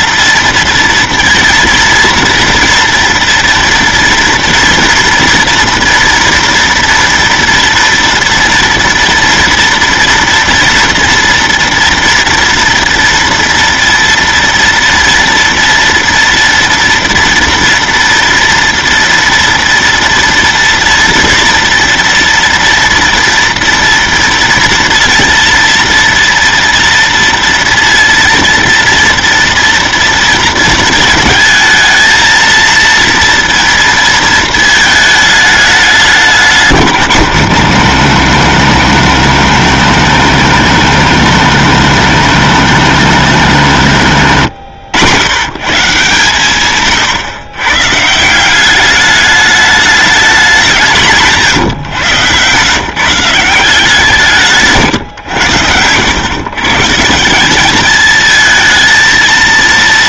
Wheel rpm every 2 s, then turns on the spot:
230, 230, 230, 230, 230, 230, 230, 230, 230, 230, 230, 230, 230, 230, 230, 230, 230, 230, 180, 100, 110, 100, 80, 130, 190, 190, 120, 150, 110, 220.
44-46